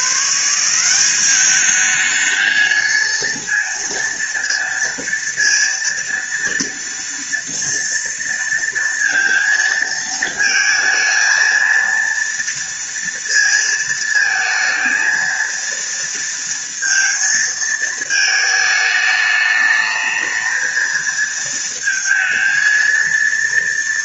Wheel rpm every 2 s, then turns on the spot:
200, 230, 230, 230, 230, 220, 230, 230, 220, 210, 220, 230.
none